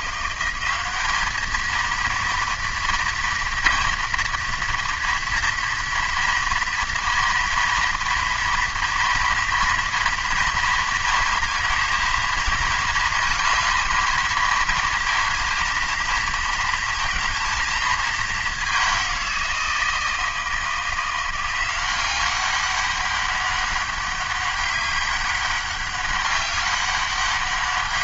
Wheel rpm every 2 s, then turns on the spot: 190, 230, 230, 230, 230, 230, 220, 220, 220, 200, 170, 200, 200, 200.
none